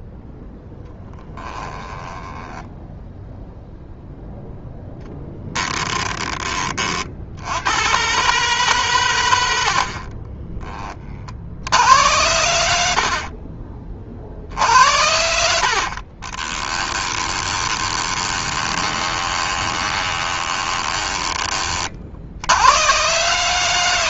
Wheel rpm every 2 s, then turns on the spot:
10, 10, 0, 30, 130, 20, 70, 70, 20, 20, 20, 100.
0-4 14-22